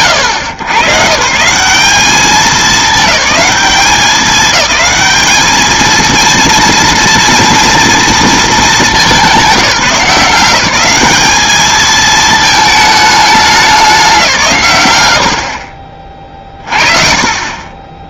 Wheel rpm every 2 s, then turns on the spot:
120, 210, 210, 230, 220, 190, 210, 110, 40.
none